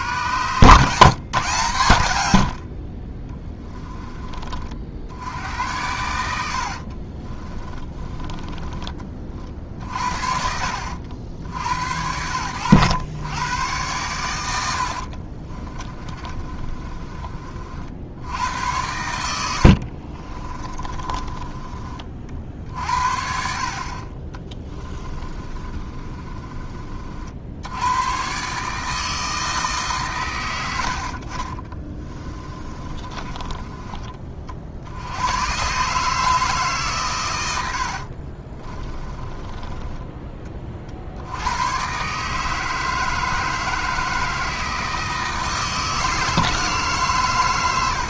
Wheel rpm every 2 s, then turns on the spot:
150, 50, 60, 50, 30, 70, 100, 70, 30, 90, 30, 50, 20, 40, 150, 90, 30, 60, 140, 30, 40, 160, 160, 150.
6-8 14-18 20-22 24-26 30-34 38-40